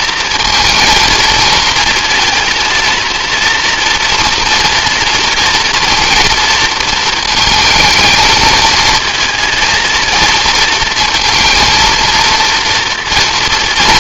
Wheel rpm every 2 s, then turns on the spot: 230, 240, 230, 220, 230, 230, 230.
none